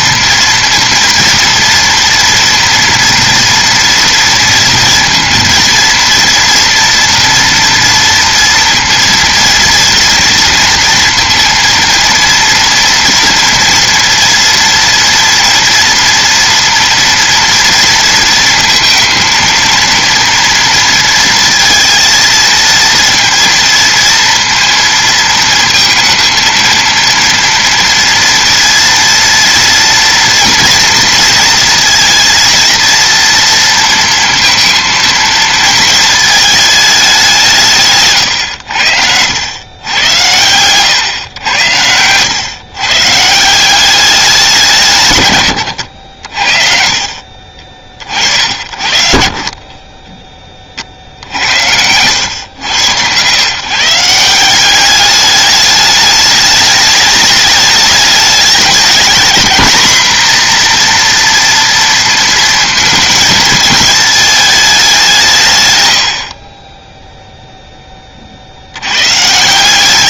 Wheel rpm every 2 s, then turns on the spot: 230, 230, 230, 230, 230, 230, 230, 230, 230, 230, 230, 230, 230, 230, 230, 230, 230, 220, 160, 90, 110, 170, 100, 40, 50, 60, 110, 210, 210, 220, 240, 220, 170, 0, 100.
none